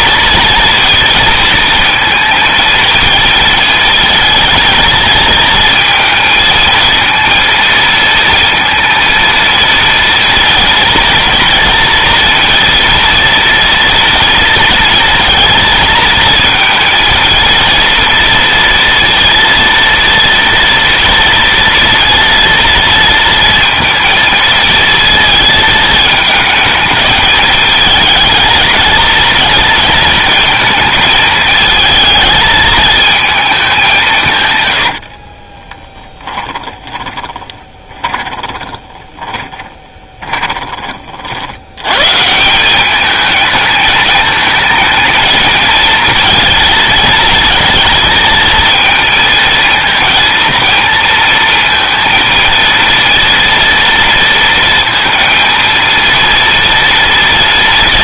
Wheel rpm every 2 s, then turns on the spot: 230, 220, 230, 230, 230, 230, 230, 230, 220, 230, 230, 230, 230, 220, 230, 220, 220, 100, 20, 20, 40, 190, 220, 220, 220, 230, 230, 230, 230.
34-40